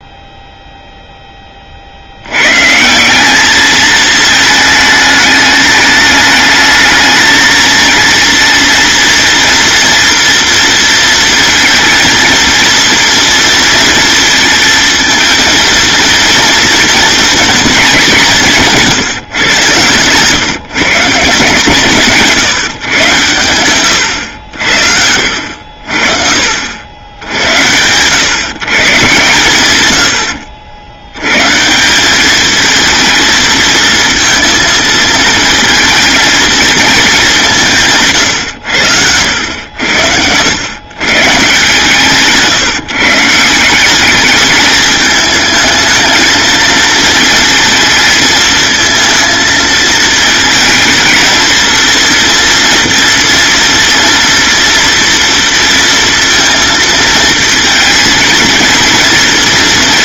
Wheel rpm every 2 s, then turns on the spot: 0, 120, 220, 210, 230, 230, 230, 220, 230, 170, 140, 150, 80, 60, 140, 80, 220, 230, 220, 100, 100, 150, 210, 220, 220, 230, 230, 230, 230, 230.
38-40